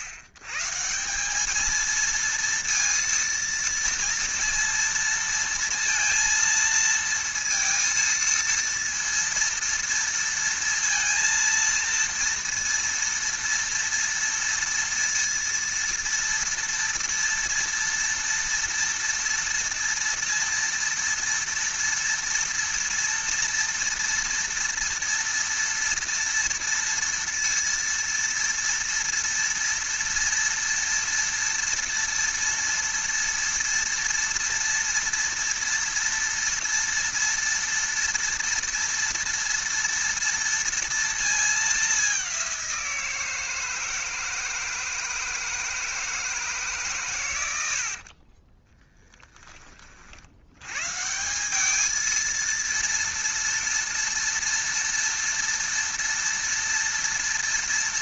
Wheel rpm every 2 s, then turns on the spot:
100, 230, 230, 230, 230, 230, 230, 230, 230, 230, 230, 230, 230, 230, 230, 230, 230, 230, 230, 230, 230, 180, 160, 150, 20, 100, 230, 230, 230.
48-50